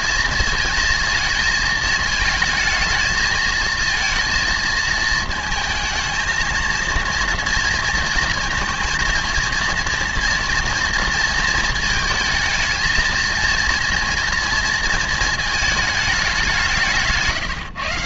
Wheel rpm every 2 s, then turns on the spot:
220, 220, 220, 230, 230, 230, 230, 230, 170.
none